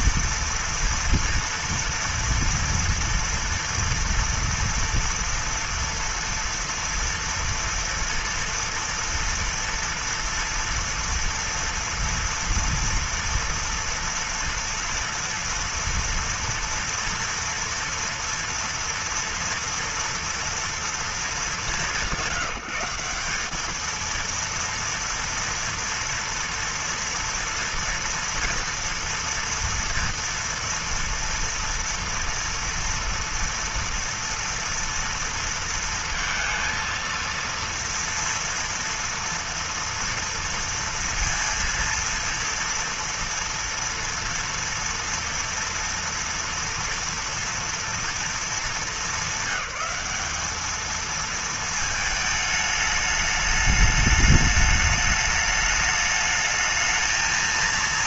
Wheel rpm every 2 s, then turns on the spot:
230, 230, 230, 230, 240, 240, 230, 230, 230, 230, 220, 170, 230, 230, 230, 230, 230, 230, 230, 230, 230, 230, 230, 230, 210, 210, 220, 210, 210.
none